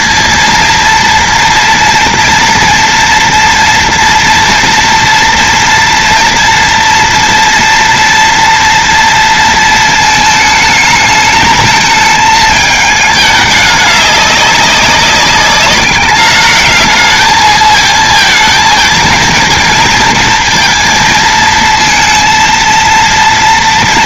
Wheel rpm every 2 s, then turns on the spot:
230, 230, 230, 240, 230, 220, 220, 200, 210, 220, 230, 230.
none